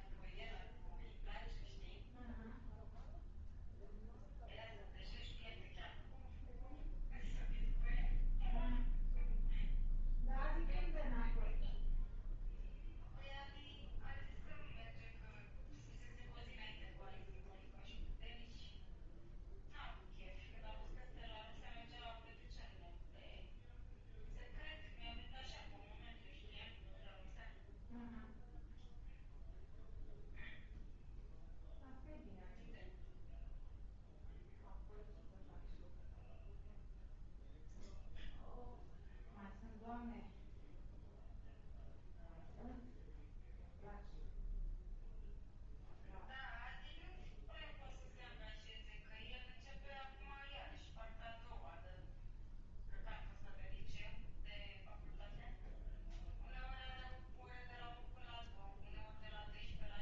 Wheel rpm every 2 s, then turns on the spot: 0, 0, 0, 0, 0, 0, 0, 0, 0, 0, 0, 0, 0, 0, 0, 0, 0, 0, 0, 0, 0, 0, 0, 0, 0, 0, 0, 0, 0, 0.
none